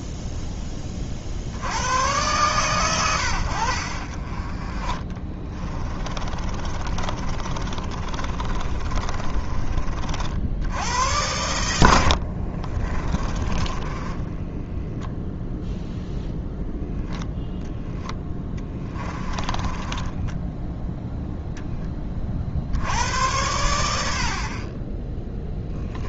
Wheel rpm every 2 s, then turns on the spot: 20, 110, 30, 40, 30, 90, 30, 0, 0, 10, 0, 60, 30.
6-10 12-14 18-20